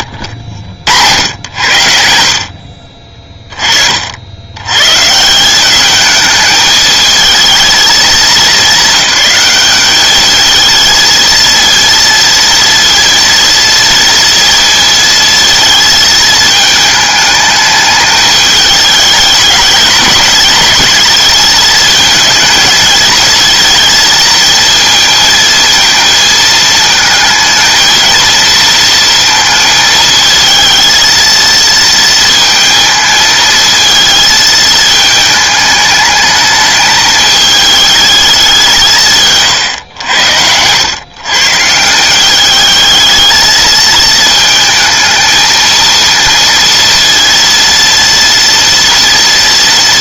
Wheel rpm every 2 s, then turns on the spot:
80, 40, 110, 220, 210, 220, 230, 230, 220, 210, 210, 220, 230, 230, 230, 220, 230, 220, 210, 180, 100, 210, 220, 230, 230.
none